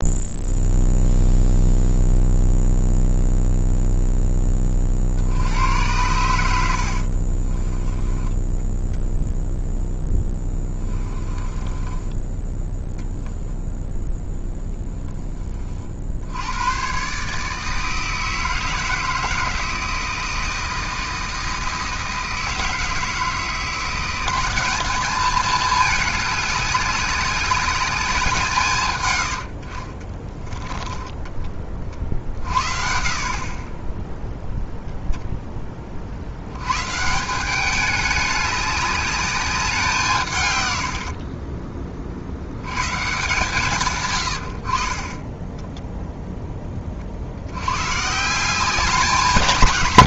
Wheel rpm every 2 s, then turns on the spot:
0, 0, 40, 60, 10, 10, 0, 10, 120, 160, 160, 160, 200, 200, 140, 20, 40, 0, 130, 200, 90, 120, 30, 30, 190.
6-8 10-12 30-32 40-42